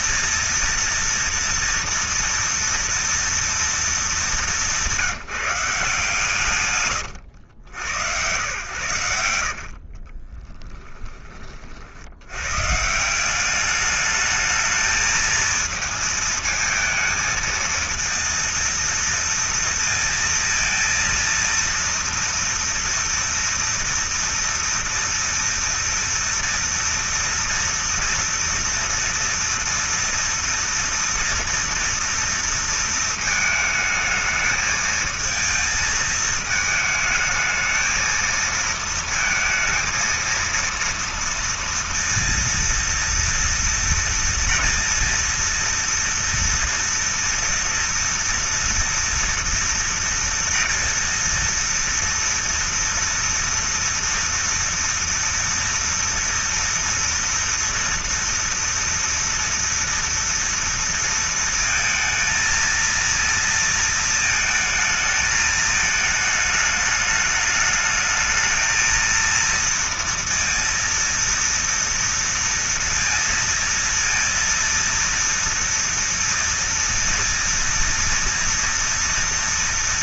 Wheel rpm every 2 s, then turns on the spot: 230, 230, 210, 150, 110, 40, 90, 210, 220, 230, 230, 230, 230, 230, 230, 230, 230, 220, 220, 230, 230, 230, 230, 230, 230, 230, 230, 230, 230, 230, 230, 230, 230, 220, 220, 230, 230, 230, 230, 230.
10-12